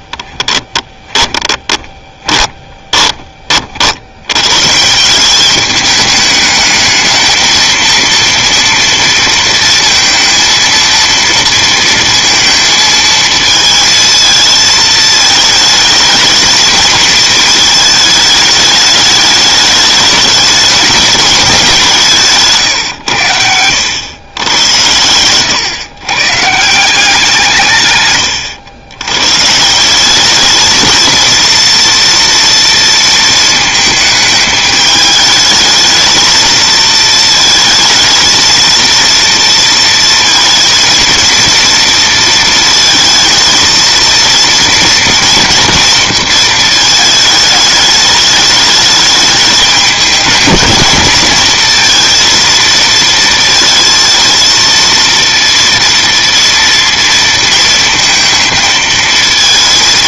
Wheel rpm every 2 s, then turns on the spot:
10, 20, 160, 220, 230, 230, 220, 220, 220, 210, 210, 130, 90, 170, 100, 220, 230, 210, 220, 230, 230, 230, 230, 220, 210, 230, 230, 230, 230, 220.
0-2